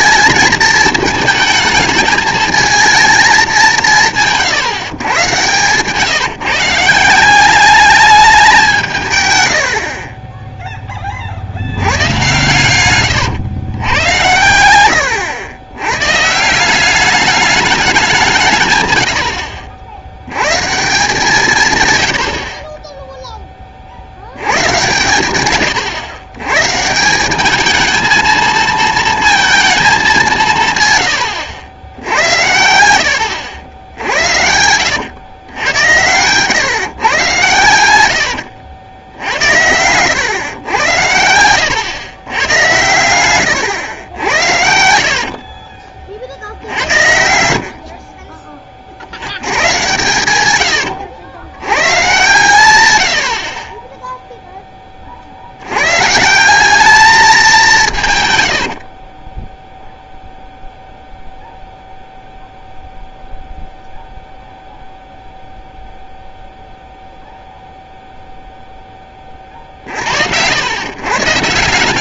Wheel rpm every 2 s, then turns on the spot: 220, 220, 150, 160, 180, 10, 110, 90, 180, 130, 140, 30, 110, 140, 220, 140, 90, 90, 140, 90, 100, 110, 70, 70, 30, 90, 110, 20, 200, 80, 0, 0, 0, 0, 0, 120.
12-14 44-46 50-52 58-60